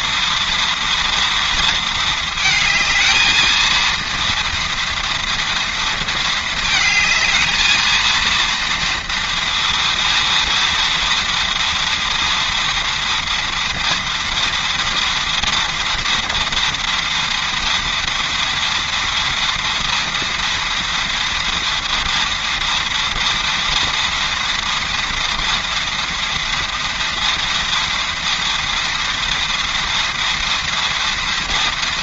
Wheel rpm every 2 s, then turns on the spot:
240, 220, 230, 220, 230, 230, 230, 230, 230, 230, 230, 230, 230, 230, 230, 230.
none